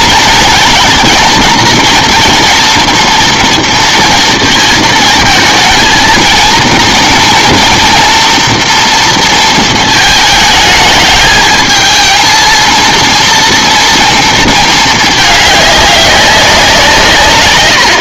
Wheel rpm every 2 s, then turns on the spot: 230, 240, 230, 230, 230, 220, 230, 220, 170.
none